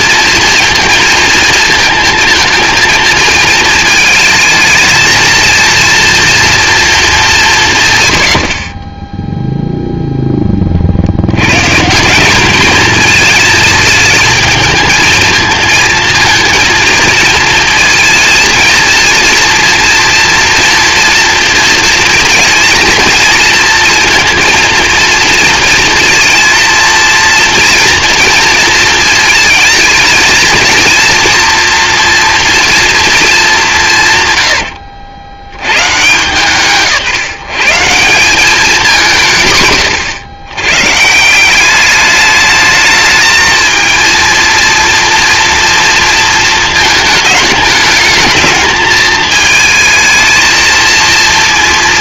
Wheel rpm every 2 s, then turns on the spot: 230, 220, 220, 230, 50, 10, 200, 220, 230, 230, 230, 230, 230, 230, 230, 220, 240, 100, 130, 200, 100, 210, 230, 230, 220, 220.
34-36